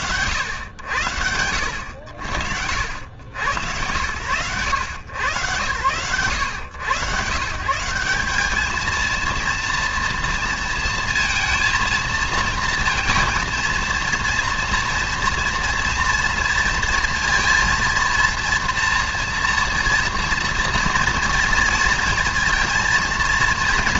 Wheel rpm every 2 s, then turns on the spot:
100, 80, 100, 120, 230, 230, 230, 230, 230, 230, 230, 230.
none